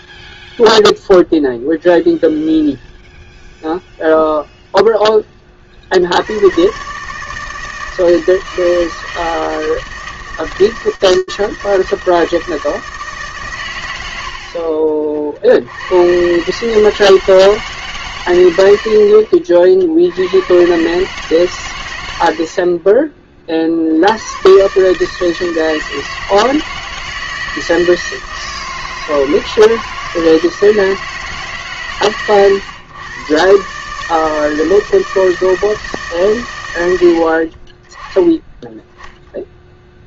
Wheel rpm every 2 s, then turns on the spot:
0, 0, 0, 120, 160, 160, 160, 40, 140, 90, 130, 40, 160, 160, 160, 150, 120, 160, 70, 0.
none